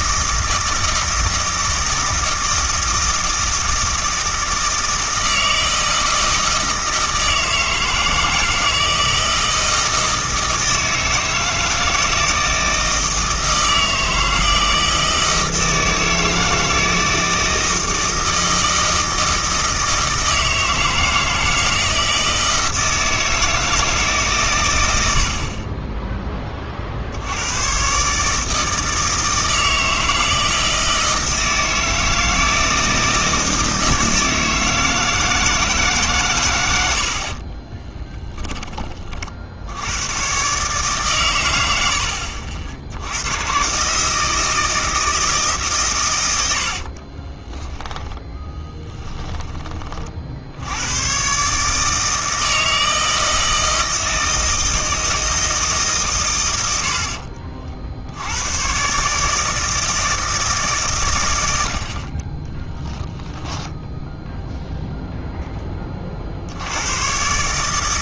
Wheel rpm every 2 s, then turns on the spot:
160, 160, 160, 160, 160, 160, 160, 160, 160, 160, 160, 160, 110, 30, 160, 160, 160, 160, 100, 30, 140, 70, 160, 60, 10, 80, 160, 160, 70, 120, 140, 10, 0, 100.
46-50 62-64